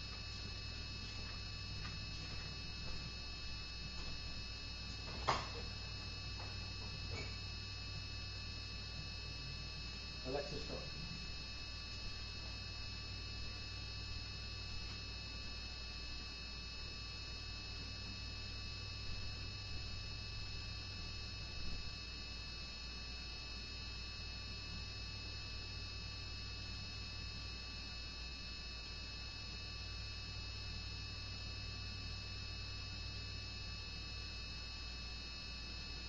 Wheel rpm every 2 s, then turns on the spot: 0, 0, 0, 0, 0, 0, 0, 0, 0, 0, 0, 0, 0, 0, 0, 0, 0, 0.
none